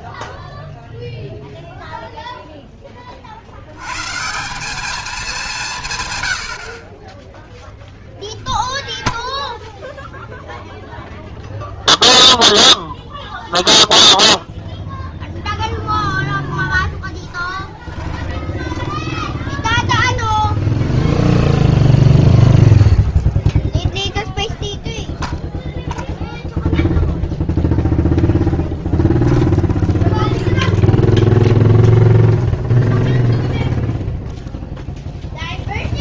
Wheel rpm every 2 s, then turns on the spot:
0, 50, 180, 0, 10, 0, 0, 0, 10, 10, 10, 0, 0, 0, 10, 20, 20, 0.
8-10 16-22 28-34